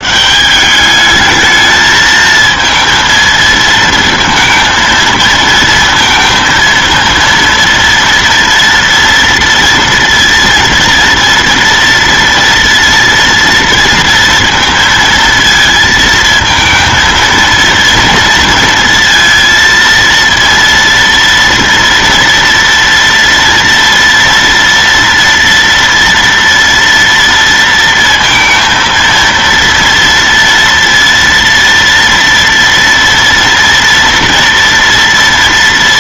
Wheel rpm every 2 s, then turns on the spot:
160, 220, 230, 230, 230, 230, 230, 230, 220, 230, 230, 230, 230, 240, 230, 230, 230, 230.
none